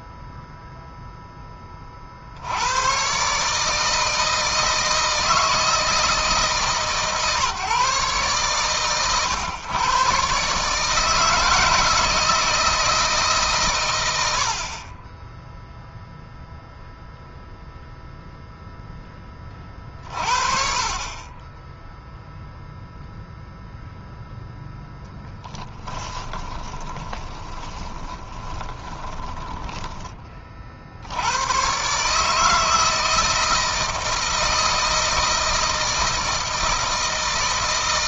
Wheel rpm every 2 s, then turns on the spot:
0, 90, 160, 150, 130, 140, 160, 60, 0, 0, 40, 0, 0, 20, 20, 50, 160, 160, 160.
26-30